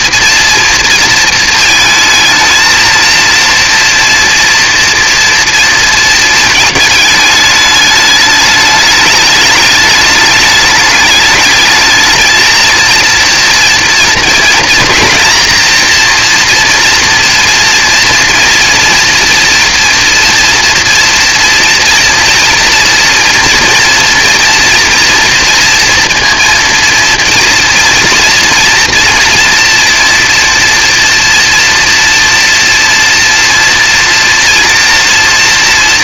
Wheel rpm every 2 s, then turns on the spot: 230, 230, 230, 220, 210, 210, 220, 230, 240, 230, 230, 240, 230, 230, 230, 230, 230, 240.
none